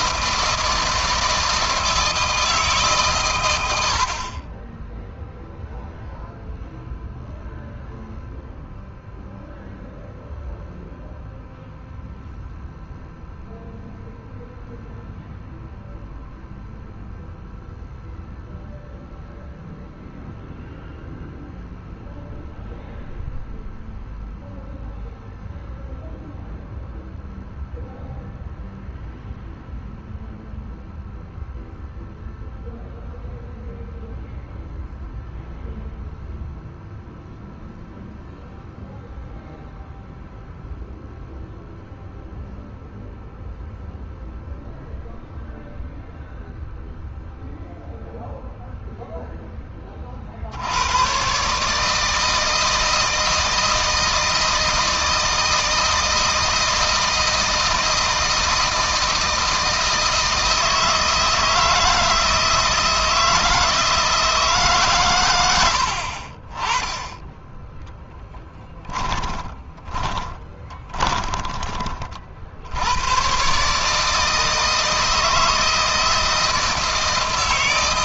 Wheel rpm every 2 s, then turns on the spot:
160, 150, 20, 0, 0, 0, 0, 0, 0, 0, 0, 0, 0, 0, 0, 0, 0, 0, 0, 0, 0, 0, 0, 0, 0, 90, 160, 160, 160, 160, 160, 160, 140, 40, 10, 30, 100, 160, 160.
68-72